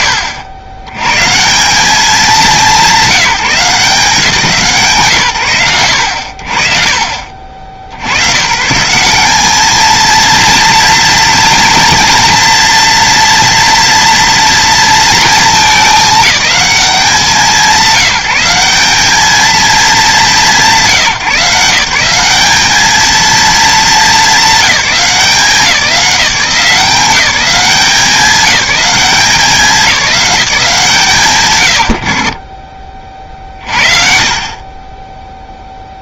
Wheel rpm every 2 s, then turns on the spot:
110, 180, 120, 60, 180, 230, 230, 230, 190, 200, 160, 220, 180, 190, 190, 120, 50, 30.
none